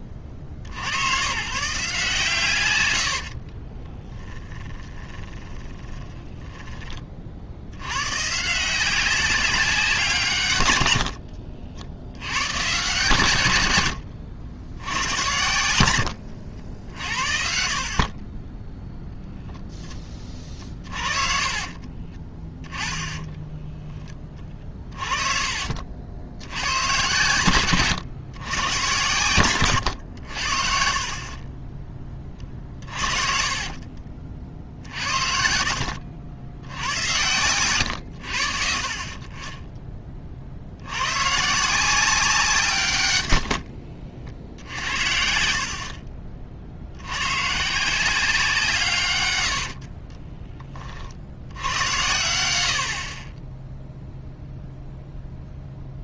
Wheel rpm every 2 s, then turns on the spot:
40, 110, 30, 20, 160, 100, 130, 90, 70, 10, 40, 20, 20, 100, 120, 60, 40, 50, 80, 50, 70, 160, 70, 60, 150, 30, 70, 0.
4-6 20-24 32-36